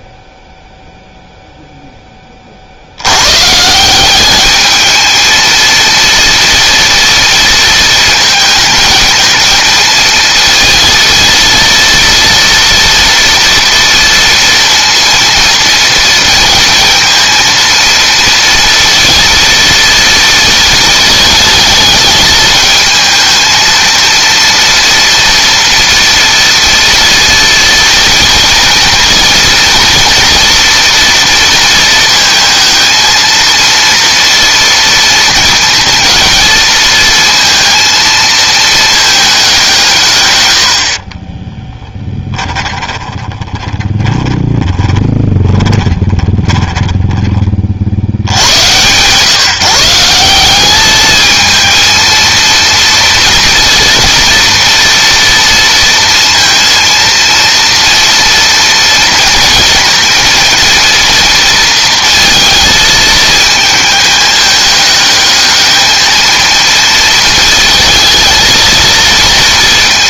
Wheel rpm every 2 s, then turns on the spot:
0, 80, 220, 230, 220, 230, 230, 230, 230, 230, 220, 220, 230, 230, 230, 230, 220, 230, 230, 220, 60, 20, 20, 10, 120, 210, 230, 230, 230, 230, 230, 220, 210, 220, 230.
42-48